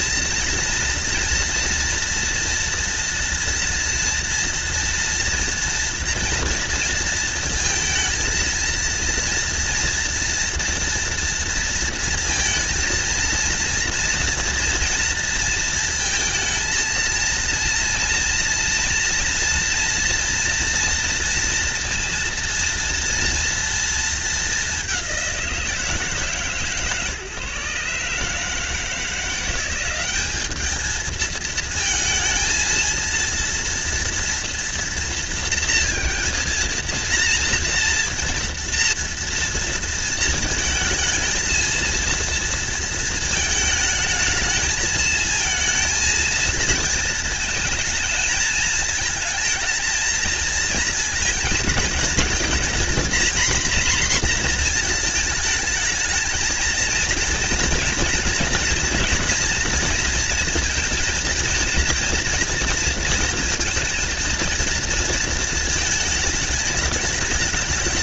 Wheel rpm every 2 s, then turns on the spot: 230, 230, 230, 230, 230, 230, 230, 230, 220, 240, 230, 230, 190, 150, 160, 220, 230, 230, 230, 230, 220, 230, 220, 220, 220, 220, 230, 230, 230, 230, 230, 230, 230, 220.
none